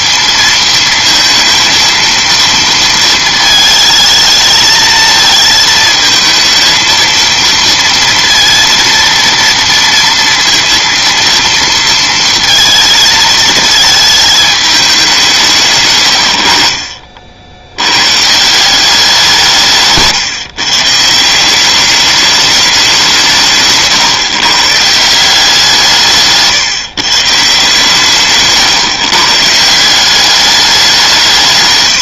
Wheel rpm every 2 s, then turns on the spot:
230, 230, 220, 220, 230, 230, 220, 210, 60, 180, 150, 200, 150, 150, 140, 200.
none